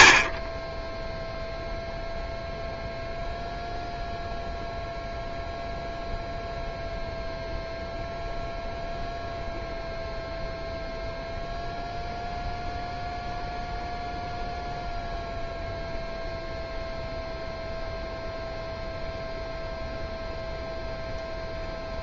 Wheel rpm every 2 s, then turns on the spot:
30, 0, 0, 0, 0, 0, 0, 0, 0, 0, 0.
none